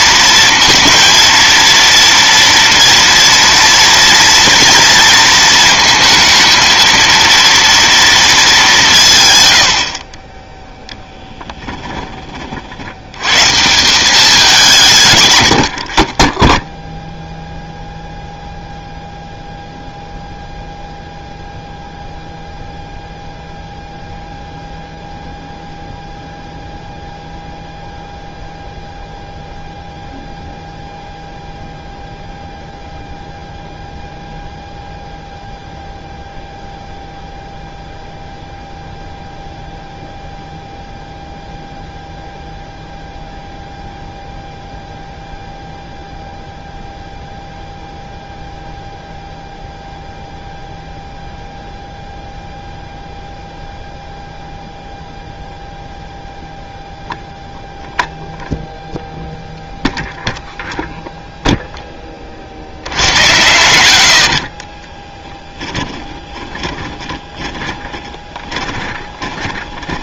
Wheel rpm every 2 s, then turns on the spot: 230, 230, 230, 230, 140, 10, 80, 150, 0, 0, 0, 0, 0, 0, 0, 0, 0, 0, 0, 0, 0, 0, 0, 0, 0, 0, 0, 0, 0, 0, 0, 70, 30, 30, 30.
10-12 64-70